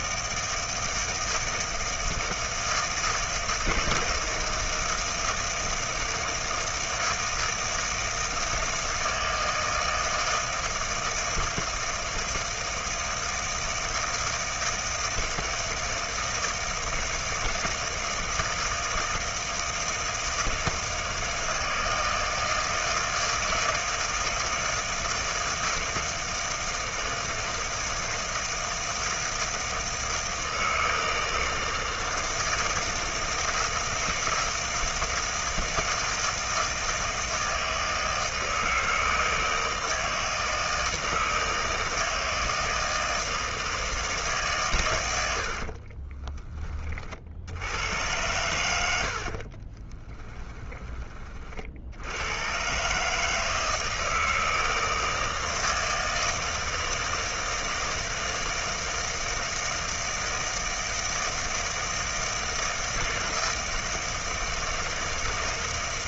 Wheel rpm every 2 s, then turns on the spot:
160, 160, 160, 160, 160, 160, 160, 160, 160, 160, 160, 160, 160, 160, 160, 160, 160, 160, 160, 160, 160, 160, 150, 20, 100, 10, 100, 160, 160, 160, 160, 160, 160.
46-48 50-52